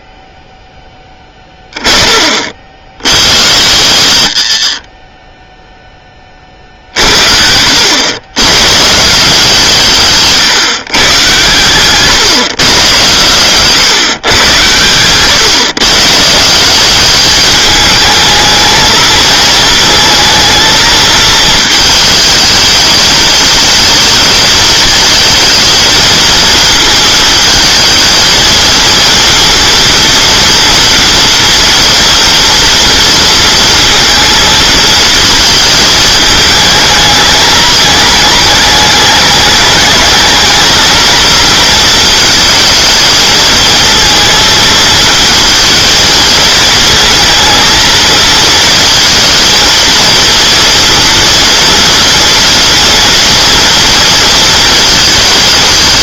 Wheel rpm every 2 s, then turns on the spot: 10, 50, 50, 50, 130, 140, 120, 110, 190, 220, 220, 220, 220, 230, 230, 230, 240, 230, 220, 210, 220, 230, 230, 230, 230, 230, 230, 230.
14-16